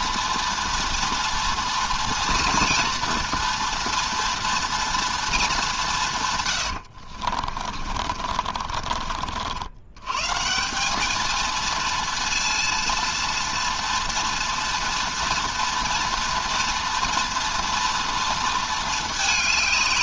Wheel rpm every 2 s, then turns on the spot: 230, 240, 230, 100, 40, 190, 230, 230, 230, 220.
6-10